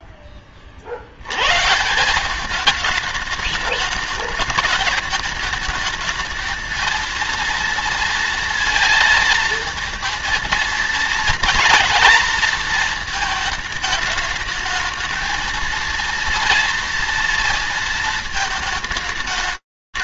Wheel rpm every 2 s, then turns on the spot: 40, 210, 210, 220, 230, 230, 230, 220, 230, 220.
none